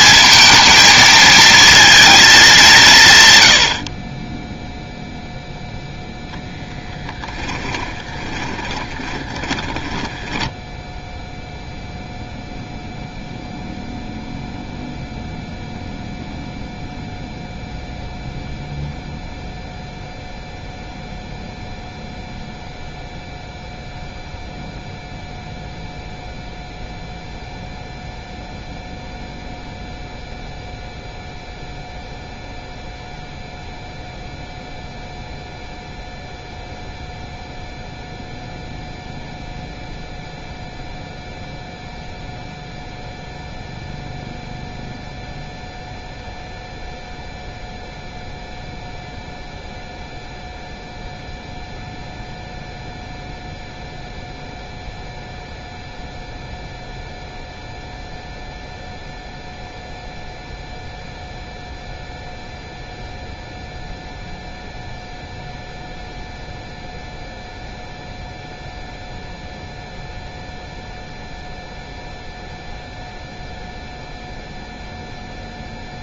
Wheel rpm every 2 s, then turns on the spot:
230, 190, 0, 10, 20, 10, 0, 0, 0, 0, 0, 0, 0, 0, 0, 0, 0, 0, 0, 0, 0, 0, 0, 0, 0, 0, 0, 0, 0, 0, 0, 0, 0, 0, 0, 0, 0, 0.
6-12